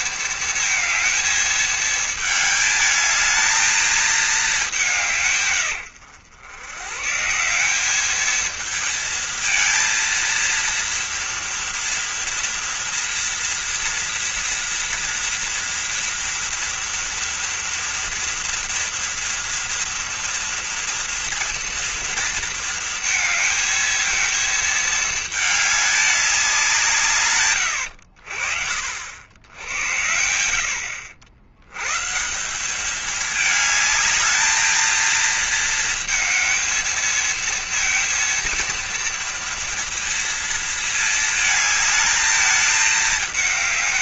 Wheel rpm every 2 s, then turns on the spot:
220, 220, 190, 110, 230, 230, 230, 230, 230, 230, 230, 230, 220, 160, 60, 90, 190, 220, 220, 230, 230, 220.
none